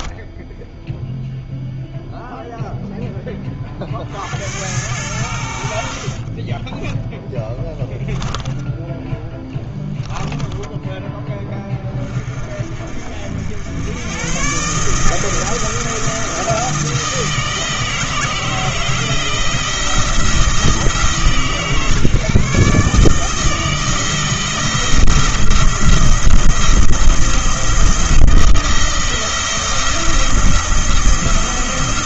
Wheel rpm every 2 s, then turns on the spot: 0, 0, 90, 10, 10, 10, 50, 150, 160, 160, 150, 150, 170, 170, 170, 170.
6-10